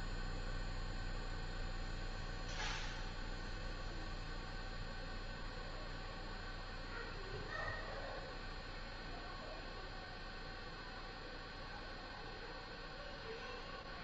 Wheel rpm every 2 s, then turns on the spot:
0, 0, 0, 0, 0, 0, 0.
none